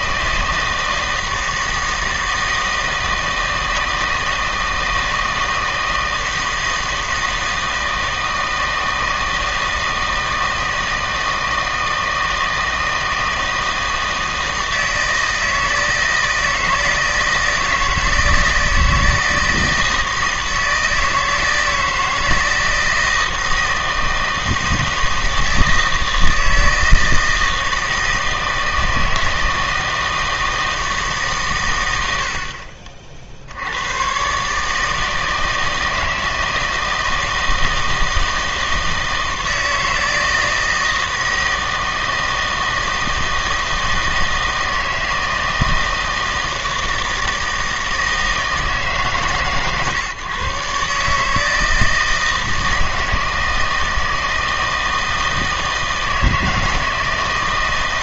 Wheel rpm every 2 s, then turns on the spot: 160, 160, 160, 160, 160, 160, 160, 160, 160, 160, 160, 160, 160, 160, 160, 160, 50, 150, 160, 160, 160, 160, 160, 160, 150, 140, 160, 160, 160.
none